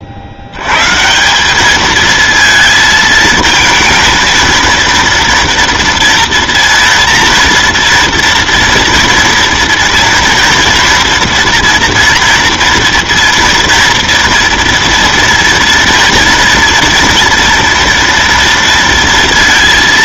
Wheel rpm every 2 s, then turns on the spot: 100, 220, 230, 230, 230, 230, 230, 230, 240, 230.
none